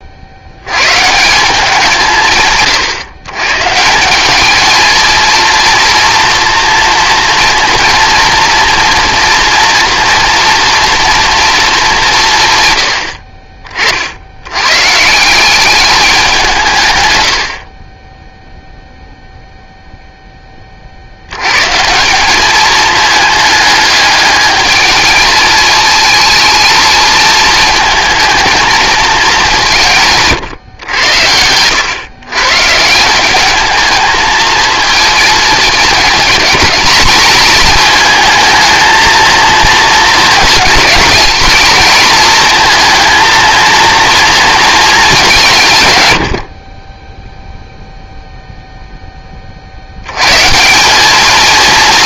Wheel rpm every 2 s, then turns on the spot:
160, 120, 220, 230, 240, 230, 60, 150, 110, 0, 50, 210, 220, 220, 220, 110, 160, 230, 210, 220, 220, 220, 220, 20, 0, 180.
none